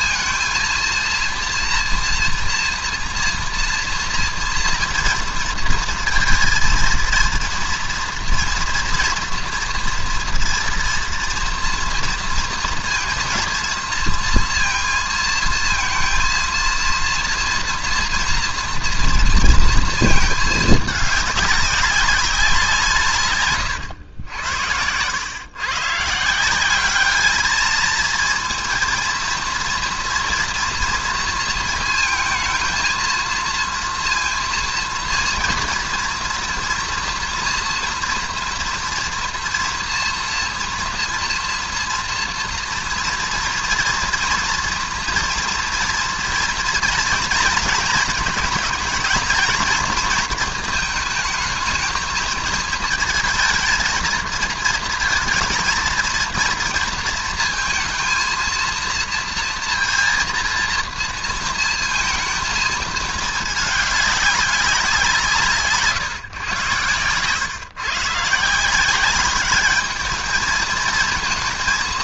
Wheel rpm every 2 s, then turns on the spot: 230, 230, 230, 230, 230, 230, 230, 230, 230, 230, 220, 180, 90, 180, 230, 230, 220, 230, 240, 240, 240, 230, 240, 240, 220, 220, 220, 230, 230, 230, 230, 220, 200, 130, 170, 220.
none